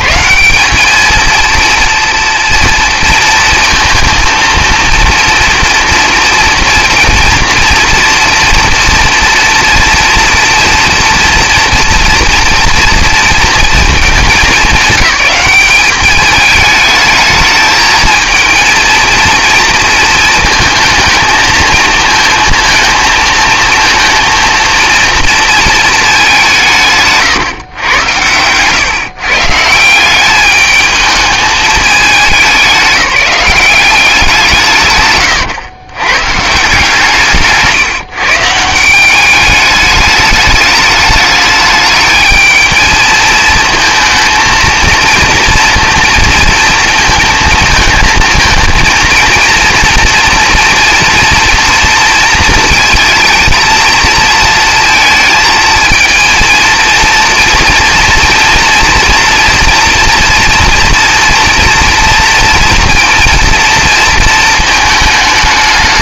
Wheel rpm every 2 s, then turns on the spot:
190, 230, 230, 230, 230, 240, 240, 210, 210, 220, 220, 230, 230, 180, 120, 200, 180, 170, 140, 160, 210, 220, 230, 230, 220, 240, 230, 230, 230, 230, 230, 230, 220.
none